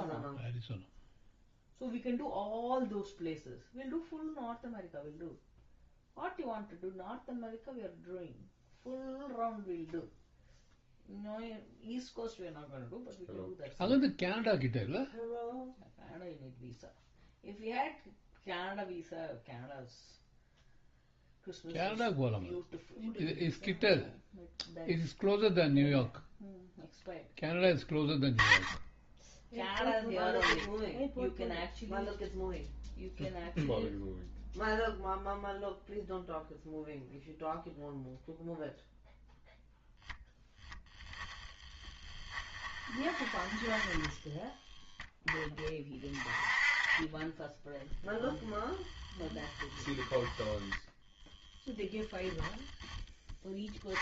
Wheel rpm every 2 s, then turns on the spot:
0, 0, 0, 0, 0, 0, 0, 0, 0, 0, 0, 0, 0, 0, 0, 10, 0, 0, 0, 0, 0, 20, 10, 30, 10, 0, 0.
48-50